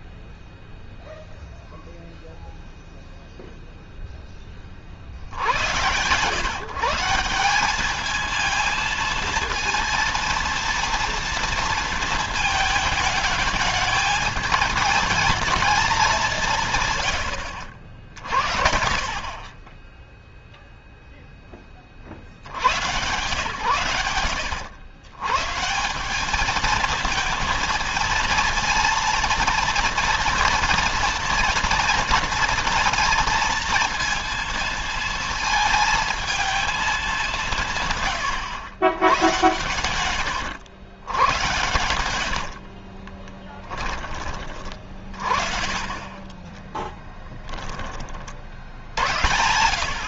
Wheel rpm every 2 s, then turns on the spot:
0, 0, 40, 160, 230, 230, 220, 220, 130, 50, 0, 100, 100, 220, 230, 230, 230, 230, 210, 110, 100, 40, 40, 10, 70.
42-44 46-50